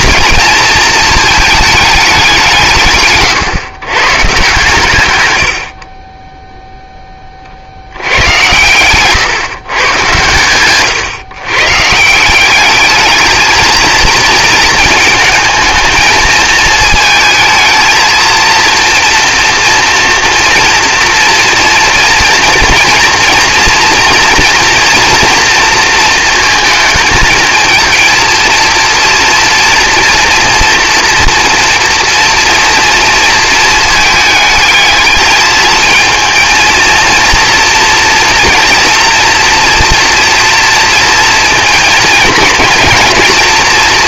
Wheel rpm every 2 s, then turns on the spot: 230, 160, 140, 0, 110, 120, 200, 220, 220, 230, 230, 240, 230, 220, 230, 240, 240, 220, 230, 230, 230, 220.
none